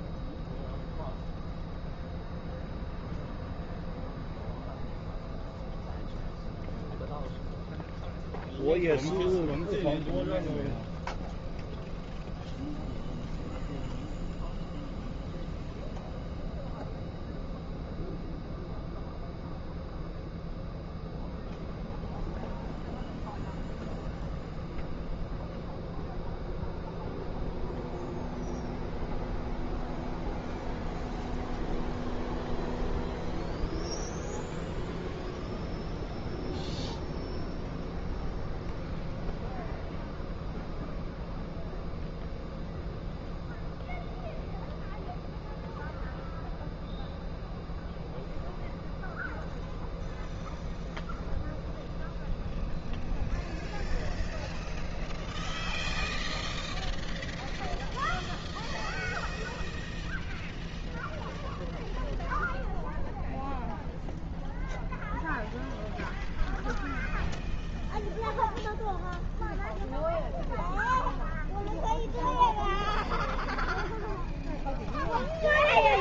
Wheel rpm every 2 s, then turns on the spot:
0, 0, 0, 0, 0, 0, 0, 0, 0, 0, 0, 0, 0, 0, 0, 0, 0, 0, 0, 0, 0, 0, 0, 0, 0, 0, 0, 0, 0, 0, 0, 0, 0, 0, 0, 0, 0, 0.
none